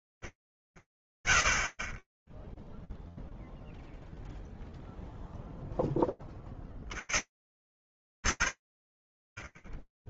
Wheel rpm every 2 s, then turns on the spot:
100, 0, 0, 130, 60.
none